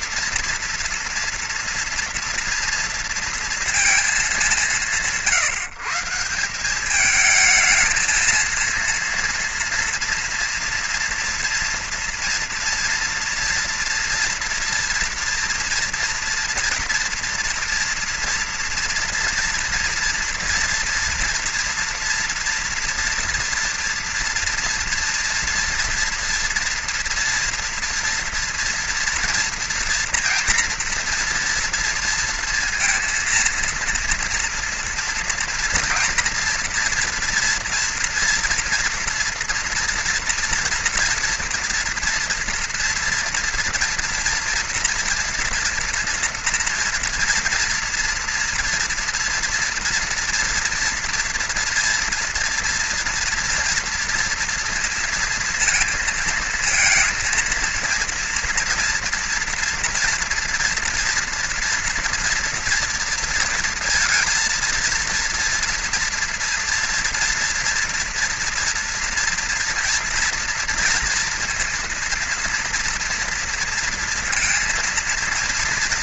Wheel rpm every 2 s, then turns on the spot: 230, 230, 150, 210, 230, 230, 230, 240, 230, 230, 230, 230, 240, 230, 230, 230, 230, 230, 230, 240, 230, 230, 230, 230, 230, 230, 240, 230, 230, 230, 230, 230, 230, 230, 230, 230, 230, 230.
none